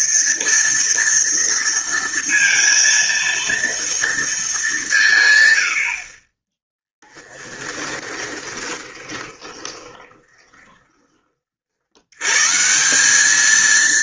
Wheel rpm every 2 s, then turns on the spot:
230, 230, 160, 10, 20, 30, 180.
6-12